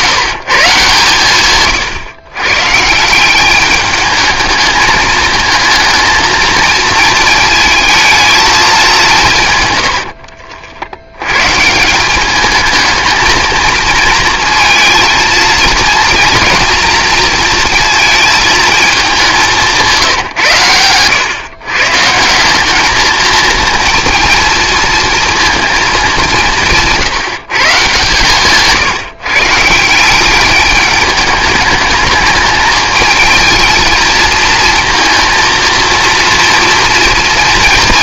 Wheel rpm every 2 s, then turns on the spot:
140, 150, 220, 220, 190, 80, 220, 220, 230, 220, 110, 210, 230, 170, 150, 210, 220, 230, 230.
none